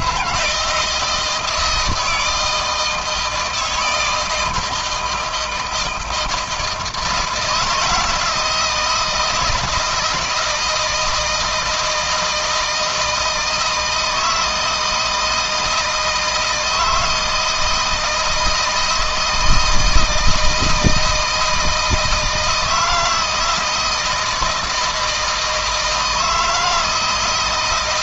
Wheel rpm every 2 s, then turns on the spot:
170, 160, 160, 160, 160, 160, 160, 160, 160, 160, 160, 160, 160, 160.
none